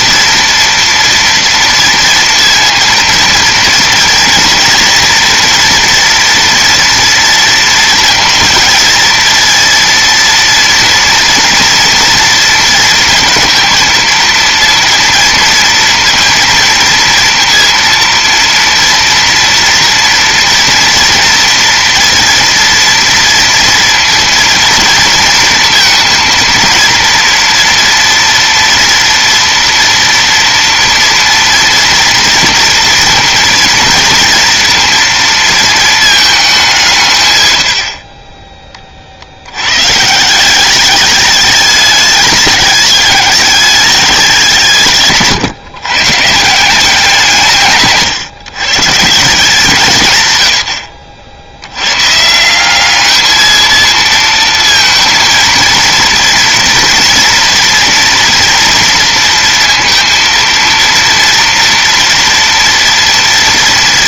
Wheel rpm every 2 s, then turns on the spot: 230, 230, 240, 230, 230, 230, 230, 230, 230, 230, 230, 230, 230, 230, 230, 230, 230, 230, 190, 20, 180, 210, 170, 170, 100, 110, 180, 230, 230, 230, 230, 230.
none